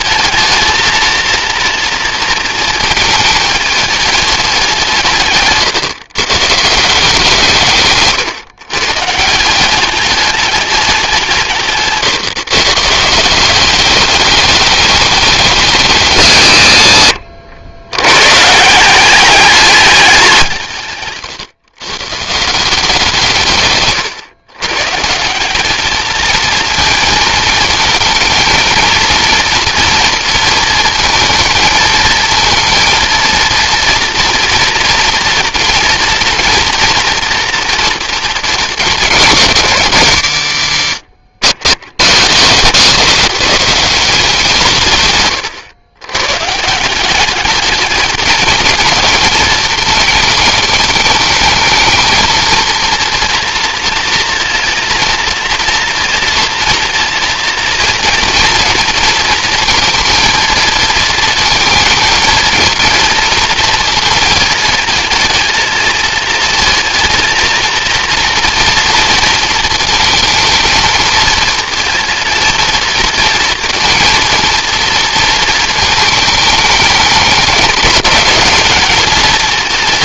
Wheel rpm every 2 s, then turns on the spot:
230, 220, 150, 170, 150, 190, 160, 210, 90, 190, 140, 170, 150, 230, 230, 230, 230, 240, 230, 210, 100, 170, 140, 180, 220, 210, 230, 230, 230, 230, 220, 230, 220, 230, 230, 230, 230, 230, 210, 220.
none